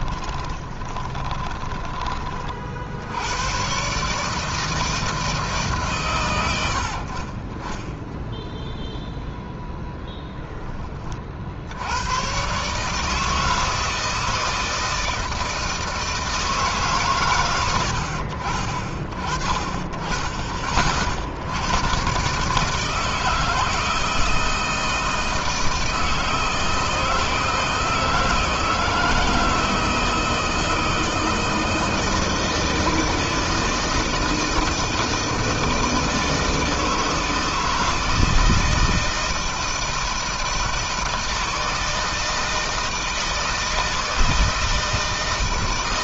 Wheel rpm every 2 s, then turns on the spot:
10, 70, 160, 60, 0, 30, 150, 160, 140, 30, 50, 150, 160, 160, 160, 160, 160, 160, 160, 160, 160, 160, 160.
0-2